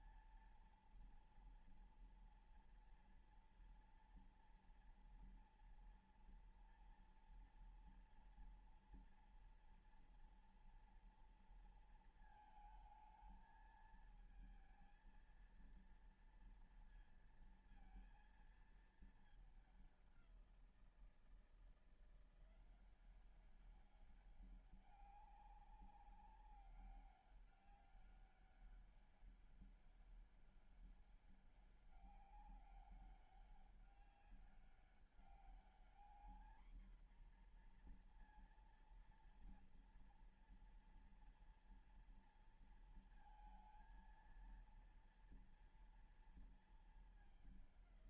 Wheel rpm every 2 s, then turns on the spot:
230, 230, 230, 230, 230, 240, 220, 220, 230, 230, 180, 170, 200, 200, 200, 200, 200, 200, 230, 240, 240, 230, 230, 220.
none